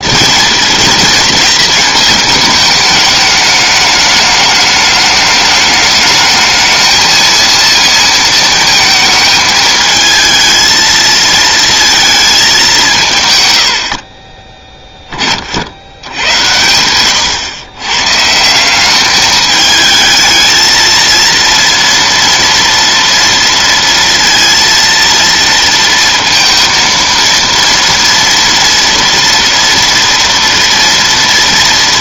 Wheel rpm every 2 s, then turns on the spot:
220, 210, 210, 220, 220, 220, 180, 20, 100, 200, 230, 230, 230, 230, 240, 230.
none